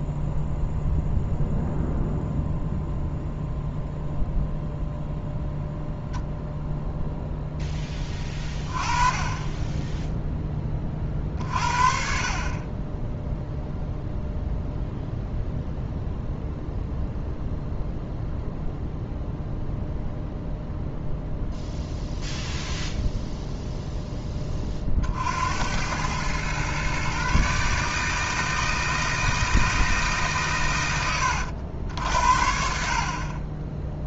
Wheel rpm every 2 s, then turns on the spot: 0, 0, 0, 0, 20, 20, 20, 0, 0, 0, 0, 0, 40, 130, 160, 110, 50.
none